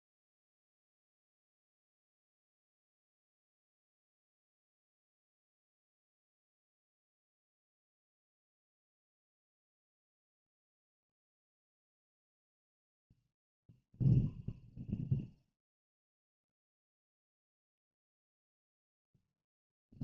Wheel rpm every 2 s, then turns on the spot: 0, 0, 0, 0, 0, 0, 0, 0, 0, 0.
none